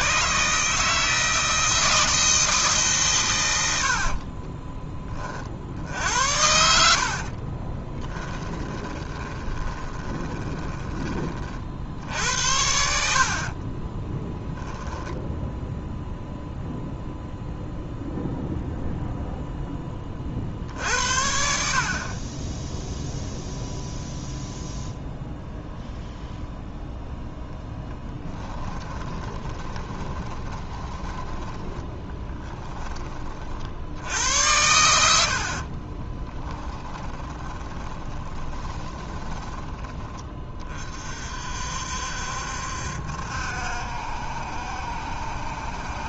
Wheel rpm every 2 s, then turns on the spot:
150, 140, 20, 60, 20, 20, 70, 10, 0, 0, 60, 0, 0, 0, 30, 20, 20, 90, 10, 20, 40, 70, 70.
6-10 12-14 28-32 36-40